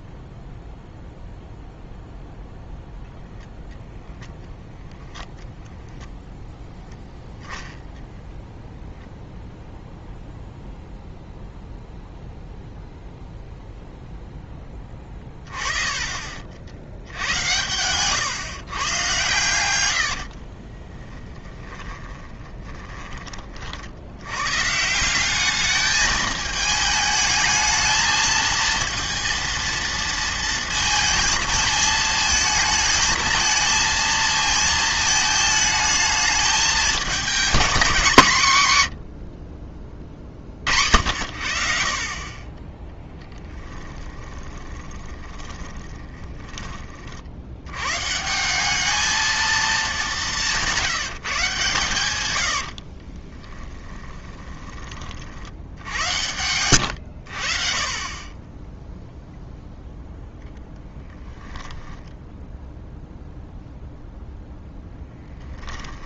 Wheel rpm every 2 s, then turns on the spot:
0, 0, 0, 0, 0, 0, 0, 10, 50, 130, 20, 20, 150, 210, 230, 230, 220, 220, 220, 130, 60, 20, 20, 20, 190, 170, 50, 20, 90, 10, 0, 0, 0.
20-24 44-46 52-54